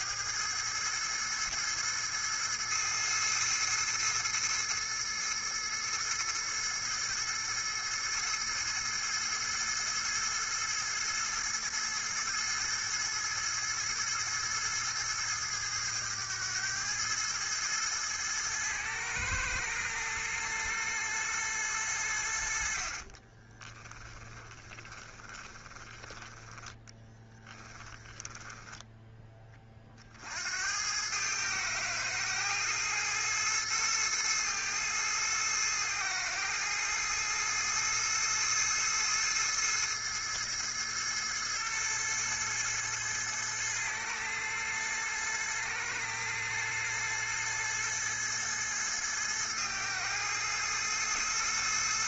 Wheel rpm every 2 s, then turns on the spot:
110, 110, 110, 110, 110, 110, 110, 110, 110, 110, 90, 20, 20, 10, 50, 110, 110, 110, 110, 110, 110, 110, 110, 110, 110, 110.
22-28